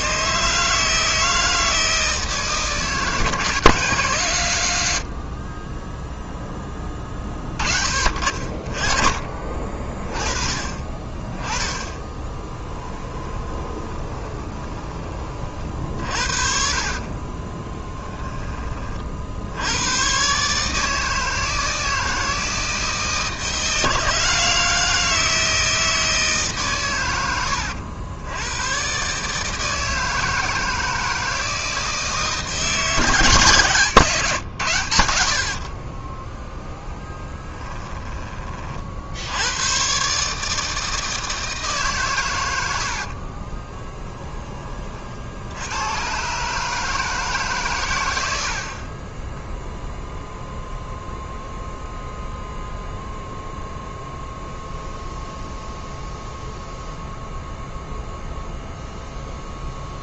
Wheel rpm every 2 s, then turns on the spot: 160, 160, 70, 20, 30, 20, 10, 30, 50, 40, 160, 160, 160, 120, 130, 160, 140, 90, 10, 60, 160, 70, 50, 160, 30, 0, 0, 0, 0, 0.
12-14 16-18 42-44